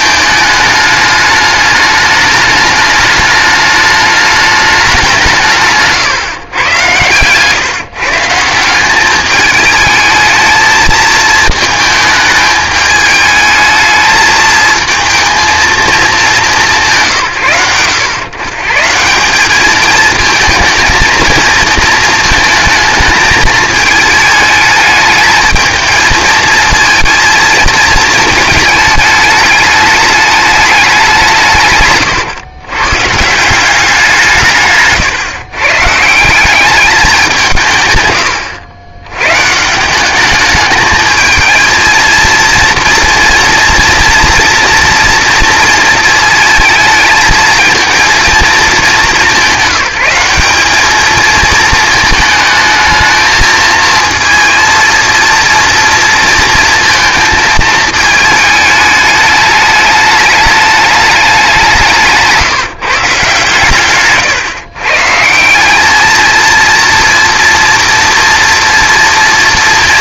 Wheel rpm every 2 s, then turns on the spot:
210, 210, 210, 110, 180, 220, 210, 220, 190, 140, 230, 220, 210, 220, 220, 200, 120, 140, 200, 90, 210, 230, 230, 220, 220, 200, 220, 230, 230, 210, 210, 160, 130, 230, 230.
none